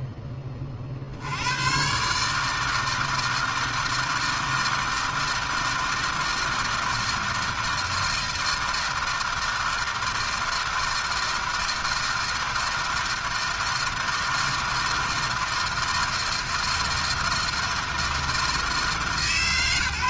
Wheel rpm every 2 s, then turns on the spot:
50, 160, 160, 160, 160, 160, 160, 160, 160, 160.
none